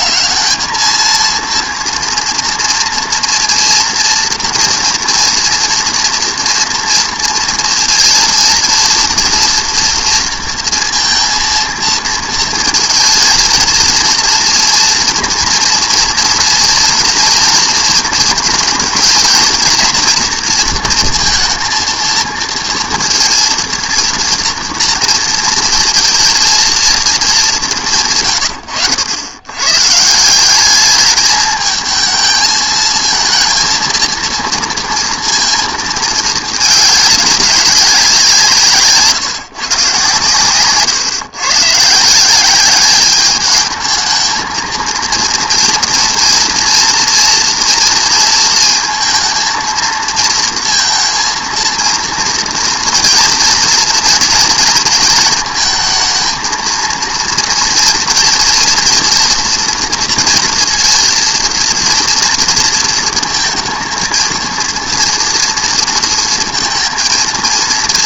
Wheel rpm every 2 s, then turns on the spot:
220, 230, 230, 230, 230, 230, 230, 230, 240, 220, 230, 230, 230, 230, 100, 200, 220, 230, 210, 160, 120, 190, 220, 230, 220, 230, 230, 230, 230, 230, 230, 230, 230, 230.
none